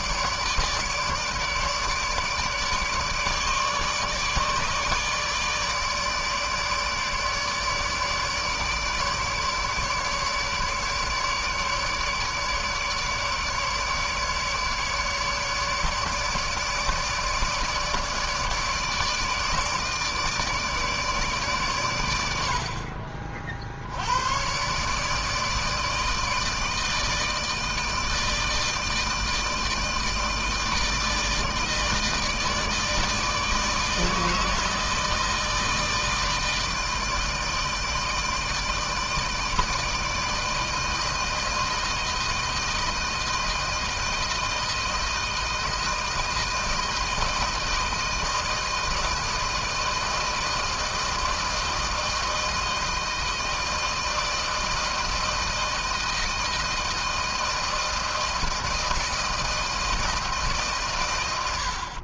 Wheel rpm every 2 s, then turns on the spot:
150, 150, 150, 150, 150, 150, 150, 150, 150, 150, 150, 70, 130, 160, 160, 160, 160, 160, 160, 160, 160, 160, 160, 160, 160, 160, 160, 160, 160, 160, 140.
none